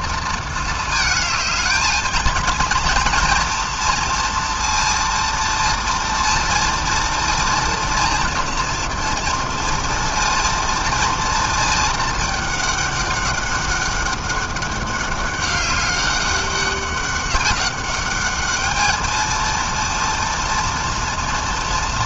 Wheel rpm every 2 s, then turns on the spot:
220, 230, 230, 230, 230, 230, 210, 200, 200, 210, 230.
none